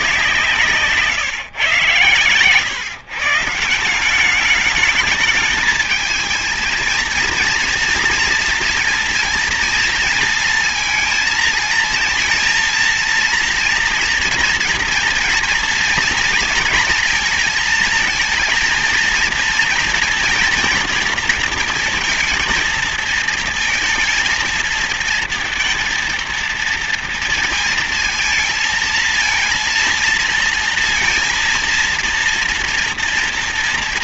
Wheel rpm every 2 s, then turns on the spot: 170, 130, 200, 220, 230, 230, 220, 230, 230, 230, 230, 230, 220, 230, 230, 230, 230.
none